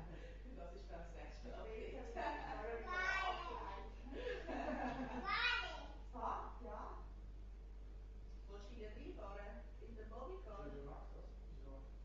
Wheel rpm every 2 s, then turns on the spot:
0, 0, 0, 0, 0, 0.
none